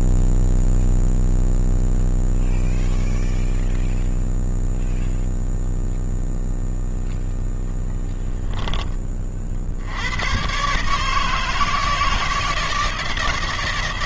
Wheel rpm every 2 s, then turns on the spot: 0, 0, 0, 0, 20, 150, 160.
none